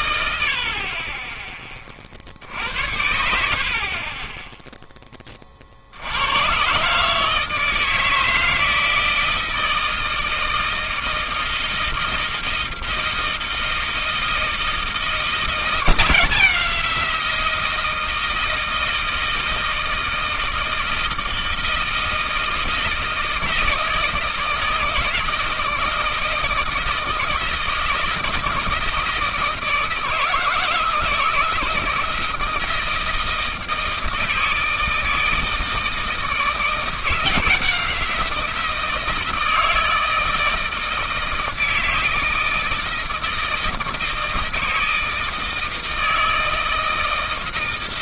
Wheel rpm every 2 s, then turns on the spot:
60, 70, 10, 110, 160, 160, 160, 160, 180, 160, 160, 160, 170, 160, 160, 160, 160, 160, 160, 170, 160, 160, 160, 160.
none